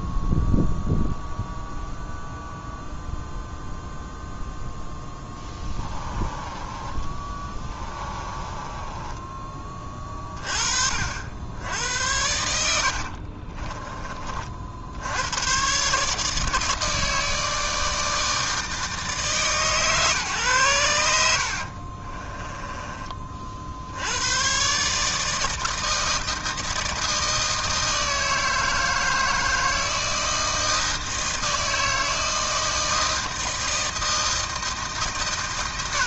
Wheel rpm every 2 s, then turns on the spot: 0, 0, 0, 20, 20, 40, 80, 50, 160, 160, 120, 20, 120, 160, 160, 160, 160, 160.
6-10 12-14 22-24